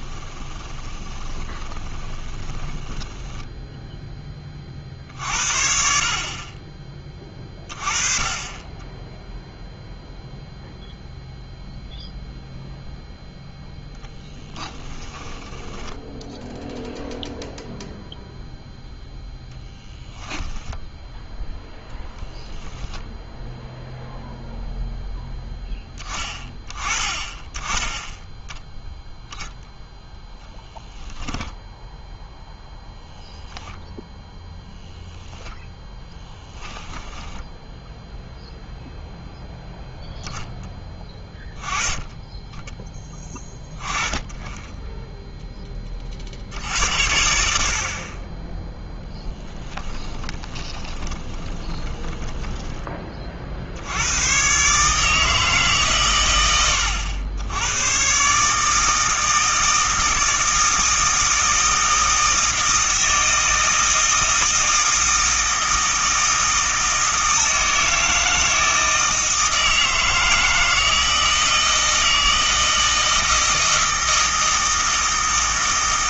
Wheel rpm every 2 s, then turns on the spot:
20, 10, 40, 30, 20, 0, 0, 10, 0, 0, 10, 0, 0, 20, 0, 10, 0, 10, 10, 0, 10, 10, 10, 80, 10, 20, 10, 140, 90, 160, 160, 160, 160, 160, 160, 160, 160, 160.
0-4 14-16 36-38 50-52